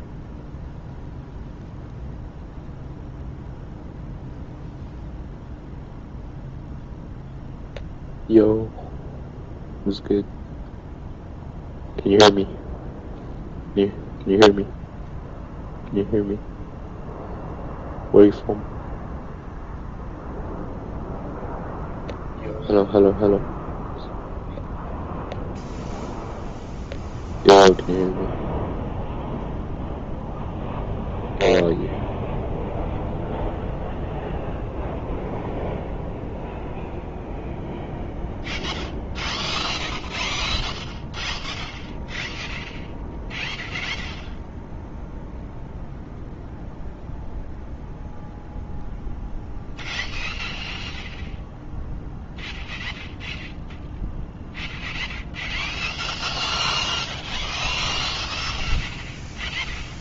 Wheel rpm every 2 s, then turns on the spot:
0, 0, 0, 0, 0, 0, 0, 0, 0, 0, 0, 0, 0, 0, 0, 0, 0, 0, 0, 0, 0, 0, 0, 0, 0, 0, 0, 0, 0, 0.
none